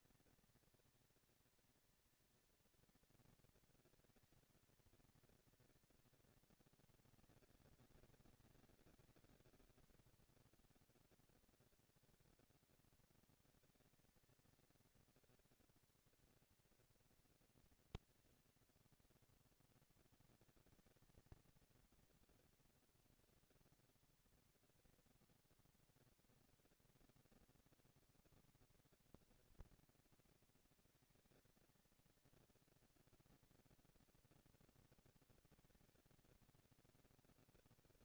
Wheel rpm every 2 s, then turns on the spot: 230, 240, 230, 220, 200, 200, 230, 230, 230, 230, 230, 240, 230, 240, 230, 230, 230, 230, 230.
none